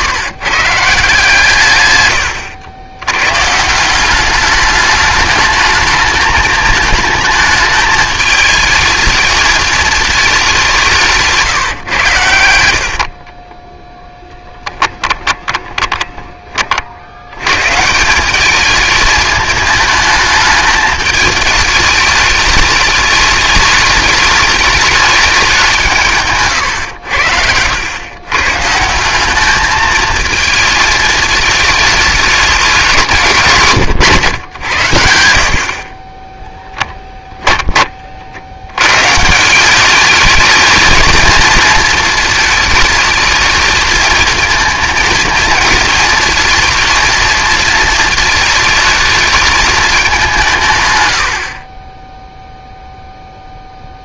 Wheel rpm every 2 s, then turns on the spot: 150, 90, 210, 220, 220, 180, 60, 10, 50, 210, 210, 210, 210, 110, 160, 220, 190, 80, 10, 110, 220, 220, 220, 230, 220, 140, 0.
12-16 26-28 36-38